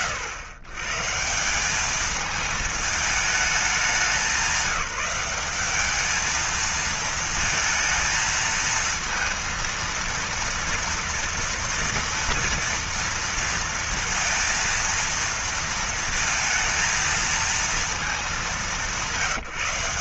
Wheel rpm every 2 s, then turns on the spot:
130, 220, 190, 220, 230, 230, 230, 230, 220, 200.
none